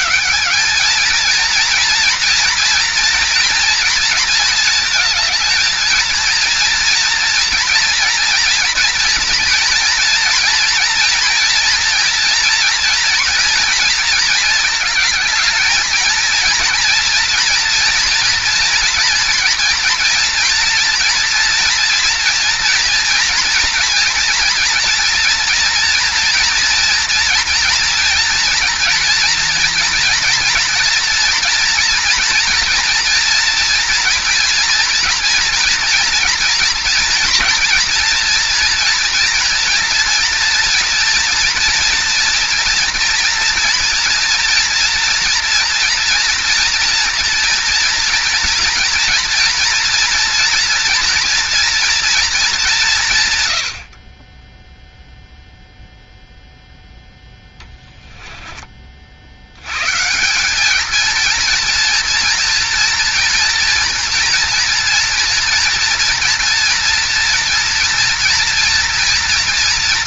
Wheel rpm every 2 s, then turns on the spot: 210, 230, 220, 230, 240, 230, 230, 220, 230, 230, 230, 240, 240, 240, 240, 230, 230, 230, 230, 240, 230, 230, 230, 230, 230, 230, 180, 0, 0, 20, 200, 230, 230, 240, 240.
none